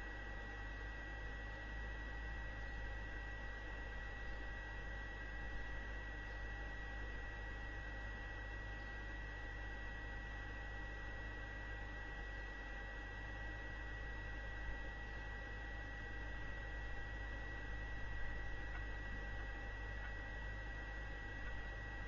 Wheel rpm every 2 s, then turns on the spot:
0, 0, 0, 0, 0, 0, 0, 0, 0, 0, 0.
none